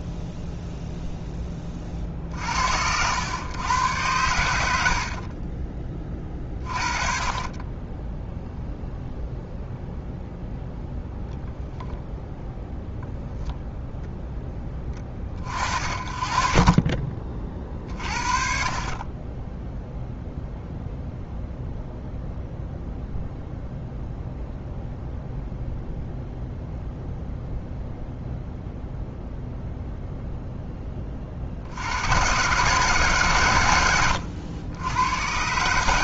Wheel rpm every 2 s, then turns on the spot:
0, 80, 70, 30, 0, 0, 0, 20, 30, 40, 0, 0, 0, 0, 0, 10, 140, 100.
4-6